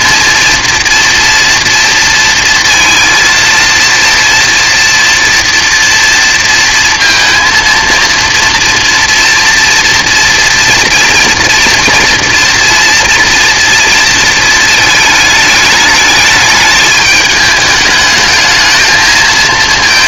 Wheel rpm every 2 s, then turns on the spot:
230, 230, 230, 230, 230, 230, 240, 220, 210, 220.
none